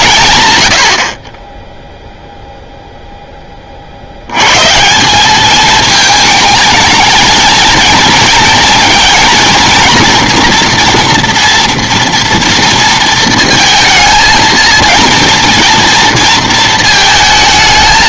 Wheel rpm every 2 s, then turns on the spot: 200, 10, 30, 210, 230, 230, 230, 220, 230.
none